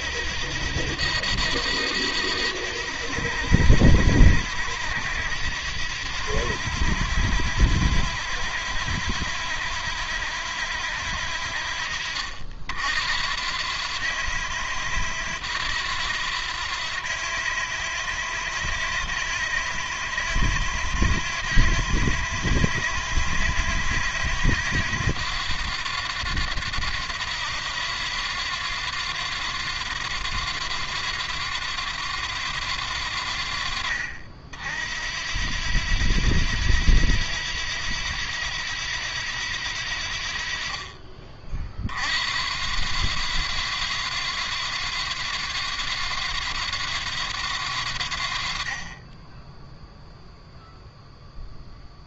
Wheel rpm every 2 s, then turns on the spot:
80, 90, 90, 90, 80, 80, 70, 90, 90, 90, 90, 90, 90, 90, 90, 90, 80, 70, 90, 90, 40, 80, 90, 90, 20, 0.
none